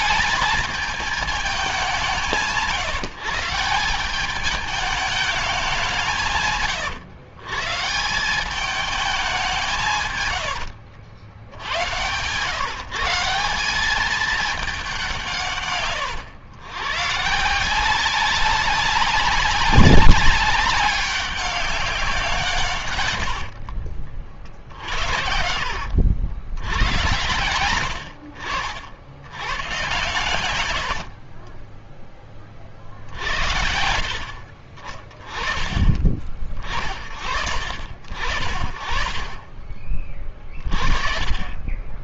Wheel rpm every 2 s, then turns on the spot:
220, 150, 200, 130, 190, 100, 120, 210, 110, 190, 200, 160, 50, 90, 60, 90, 30, 50, 30, 50, 40.
10-12 24-26